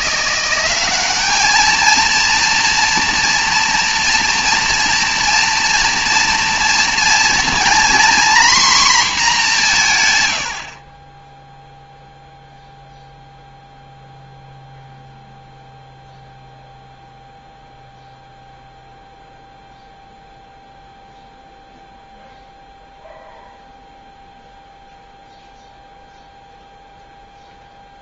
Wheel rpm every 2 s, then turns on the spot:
190, 240, 240, 230, 240, 50, 0, 0, 0, 0, 0, 0, 0, 0.
none